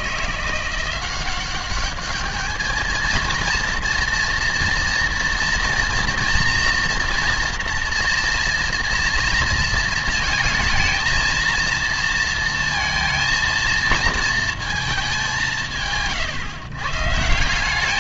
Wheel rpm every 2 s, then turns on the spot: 170, 210, 230, 230, 240, 220, 230, 220, 120.
none